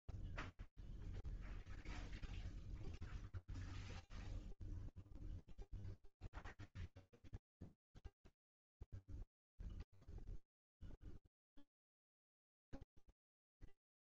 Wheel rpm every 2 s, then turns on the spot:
0, 0, 0, 0, 0, 0, 0.
none